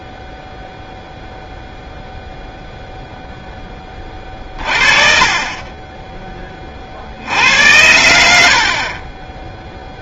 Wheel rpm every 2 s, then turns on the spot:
0, 40, 40, 30, 50.
none